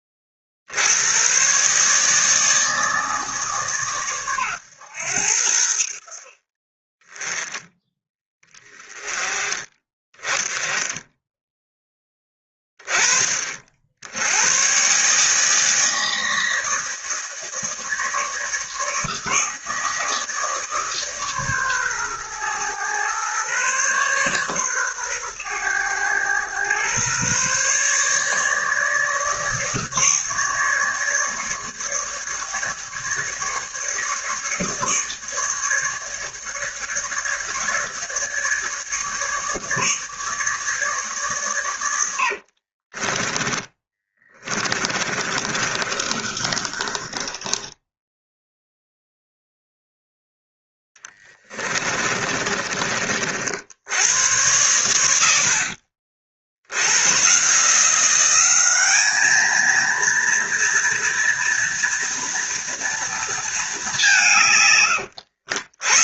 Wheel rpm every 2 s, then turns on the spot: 50, 160, 110, 30, 20, 20, 10, 120, 160, 150, 150, 120, 130, 120, 150, 150, 150, 150, 150, 150, 150, 40, 20, 30, 0, 10, 30, 100, 80, 200, 230, 230, 140.
42-48